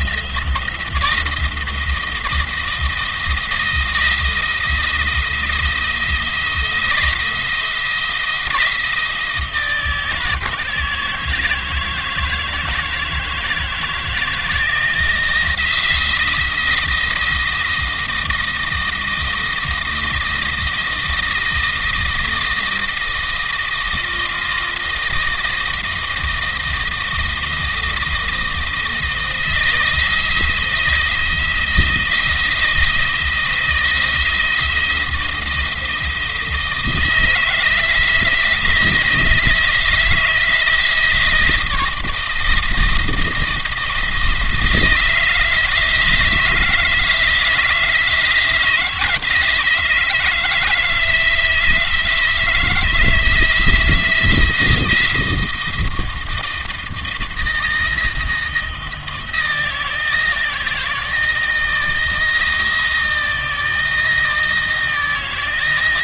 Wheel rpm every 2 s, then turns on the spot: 160, 160, 160, 170, 160, 160, 160, 170, 170, 170, 160, 170, 170, 160, 170, 170, 160, 170, 160, 170, 160, 160, 160, 160, 160, 160, 170, 170, 170, 170, 160, 160, 160.
none